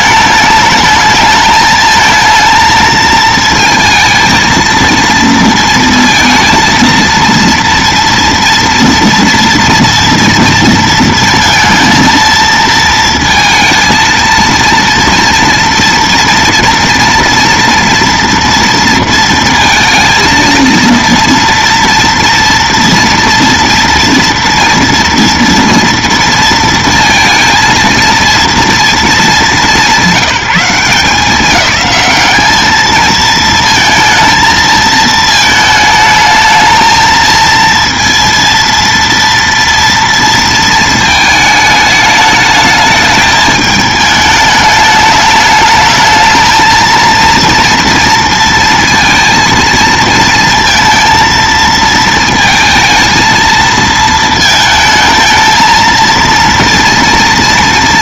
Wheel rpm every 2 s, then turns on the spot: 220, 230, 230, 230, 230, 230, 230, 230, 230, 230, 230, 230, 240, 230, 230, 190, 220, 230, 220, 230, 220, 220, 210, 230, 230, 230, 230, 220, 230.
none